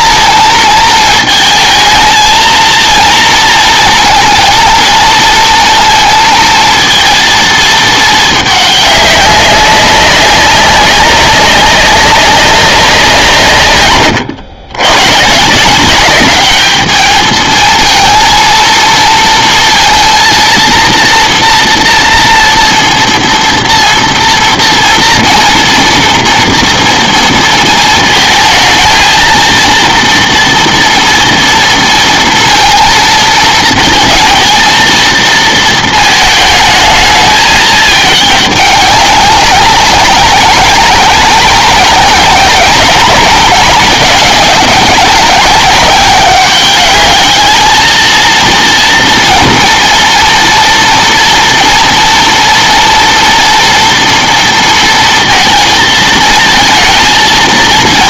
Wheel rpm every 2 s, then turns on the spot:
220, 230, 230, 230, 210, 190, 190, 100, 210, 230, 230, 230, 230, 230, 220, 230, 220, 220, 220, 200, 190, 190, 200, 210, 230, 230, 230, 230, 220.
none